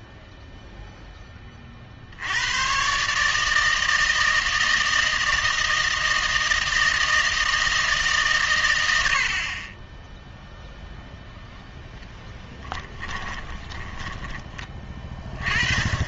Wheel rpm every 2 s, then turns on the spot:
0, 110, 160, 160, 110, 0, 10, 20.
12-14